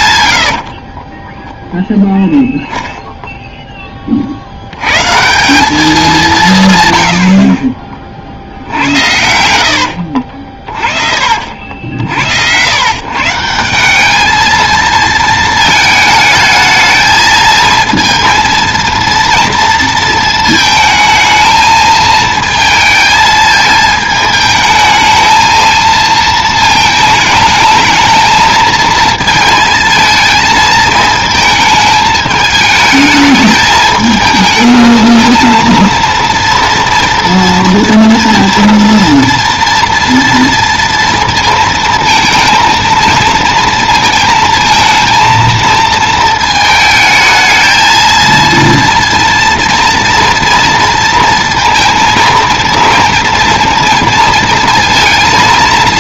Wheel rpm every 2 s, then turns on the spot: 30, 0, 110, 130, 70, 50, 120, 220, 220, 230, 220, 220, 220, 220, 220, 220, 220, 220, 230, 230, 230, 230, 230, 220, 230, 230, 230, 230.
0-2 8-10